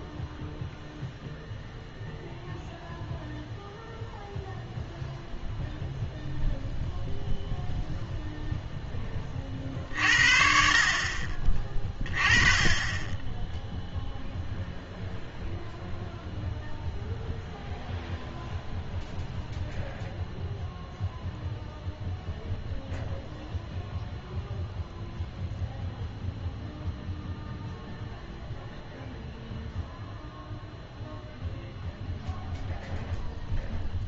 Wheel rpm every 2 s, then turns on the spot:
0, 0, 0, 0, 0, 50, 20, 0, 0, 0, 0, 0, 0, 0, 0, 0, 0.
none